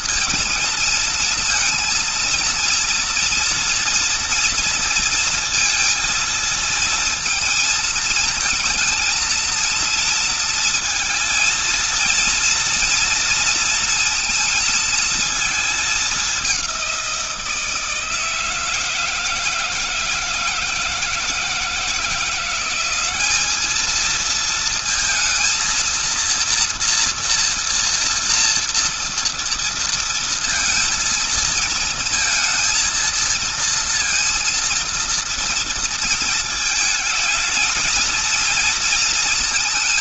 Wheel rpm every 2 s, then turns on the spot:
220, 230, 230, 230, 230, 230, 230, 230, 180, 160, 160, 180, 220, 230, 230, 230, 220, 230, 220, 230.
none